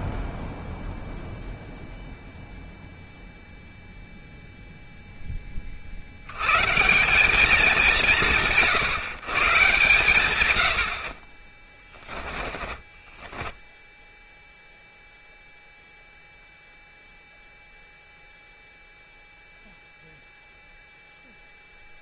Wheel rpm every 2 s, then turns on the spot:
0, 0, 0, 130, 130, 90, 20, 0, 0, 0, 0.
12-14